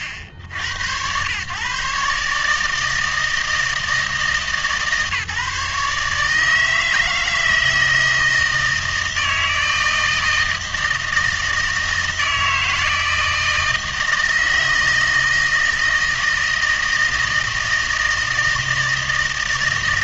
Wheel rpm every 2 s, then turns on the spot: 90, 150, 150, 160, 160, 160, 160, 160, 160, 160.
none